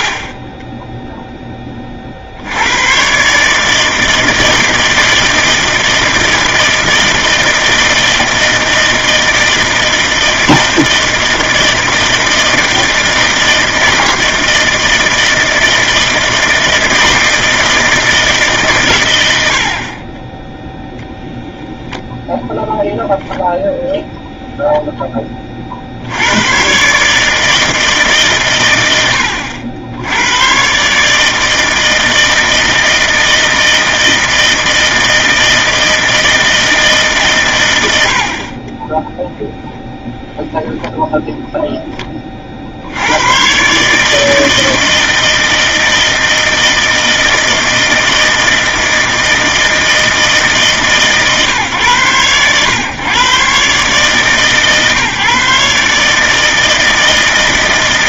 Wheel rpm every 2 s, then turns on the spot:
40, 110, 160, 160, 160, 160, 160, 160, 160, 130, 0, 0, 0, 130, 110, 130, 160, 160, 160, 20, 0, 60, 160, 160, 160, 150, 120, 140, 160.
none